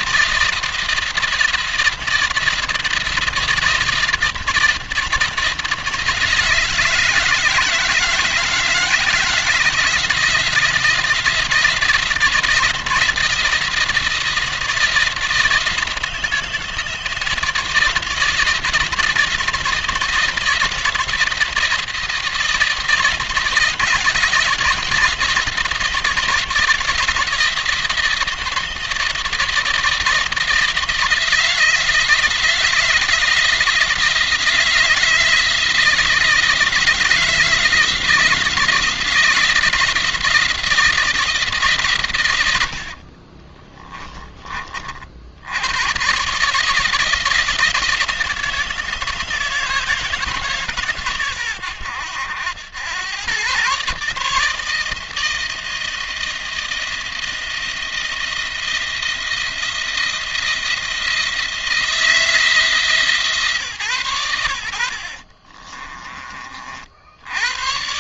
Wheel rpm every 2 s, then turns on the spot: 170, 170, 170, 170, 170, 170, 170, 170, 160, 160, 170, 160, 160, 170, 170, 160, 160, 160, 160, 170, 160, 70, 50, 160, 160, 140, 100, 160, 170, 170, 170, 160, 70, 60.
64-66